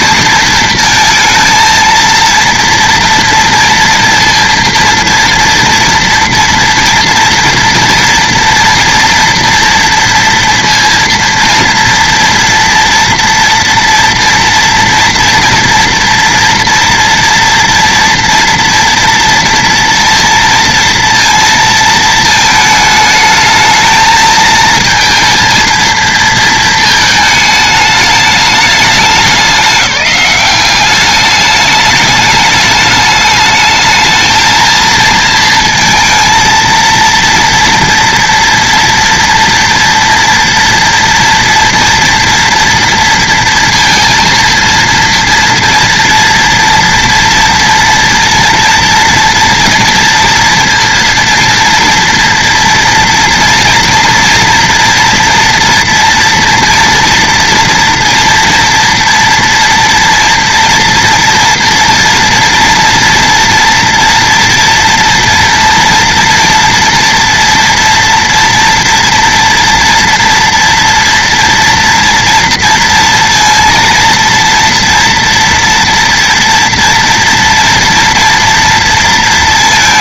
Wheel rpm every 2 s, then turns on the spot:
230, 230, 230, 230, 240, 240, 230, 230, 230, 230, 230, 220, 220, 220, 210, 190, 210, 220, 230, 230, 230, 230, 230, 230, 230, 230, 230, 230, 230, 230, 230, 230, 230, 230, 230, 230, 230, 230, 230, 230.
none